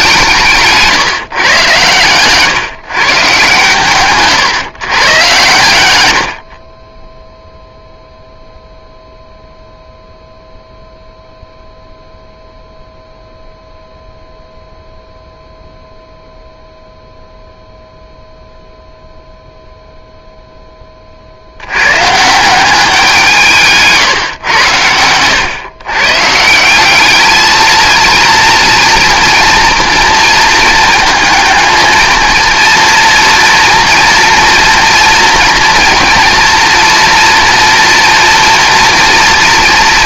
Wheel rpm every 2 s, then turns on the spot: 160, 140, 130, 50, 0, 0, 0, 0, 0, 0, 10, 180, 110, 170, 230, 230, 230, 230, 230, 240.
none